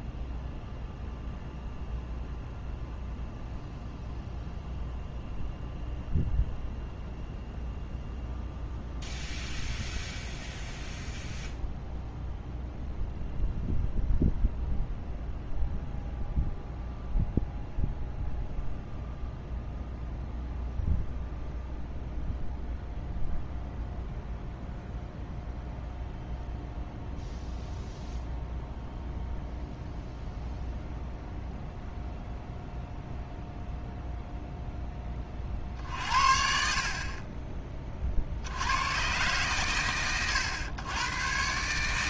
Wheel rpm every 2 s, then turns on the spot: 0, 0, 0, 0, 0, 0, 0, 0, 0, 0, 0, 0, 0, 0, 0, 0, 0, 10, 50, 100, 110.
none